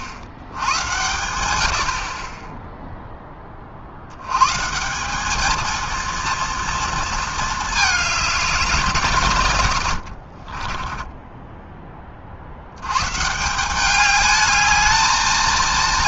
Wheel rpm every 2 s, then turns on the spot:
100, 0, 150, 230, 180, 20, 100, 210.
10-12